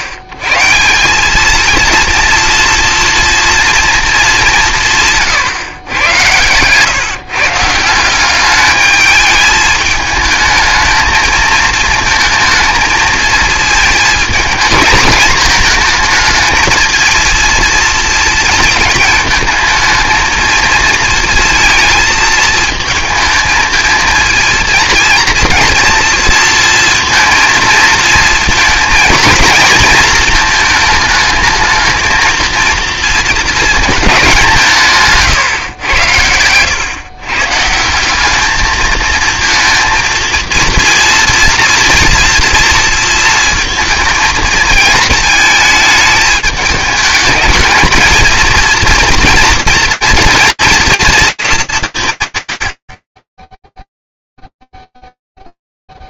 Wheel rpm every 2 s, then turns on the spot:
150, 230, 190, 120, 200, 220, 230, 230, 220, 220, 230, 220, 230, 230, 230, 220, 230, 170, 110, 210, 230, 230, 220, 210, 230, 230, 110, 0.
6-8